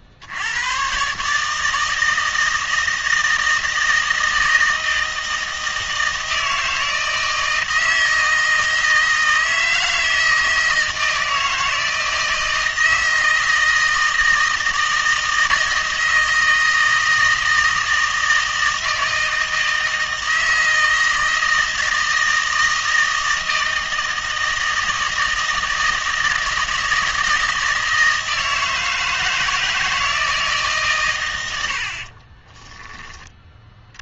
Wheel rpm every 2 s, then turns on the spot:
100, 160, 160, 160, 160, 160, 160, 160, 160, 160, 160, 160, 160, 160, 160, 140, 10.
none